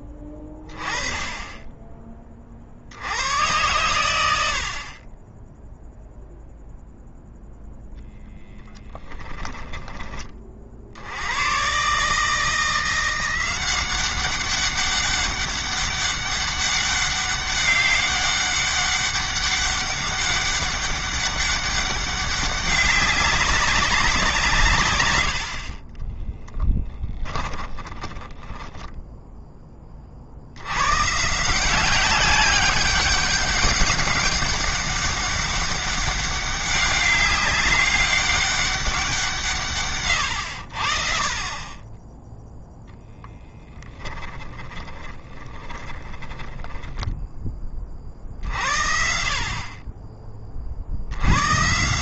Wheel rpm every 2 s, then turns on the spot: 20, 80, 50, 0, 10, 60, 170, 200, 200, 200, 200, 190, 130, 10, 10, 110, 200, 200, 200, 190, 60, 0, 20, 10, 50, 70.
8-10 26-28 44-48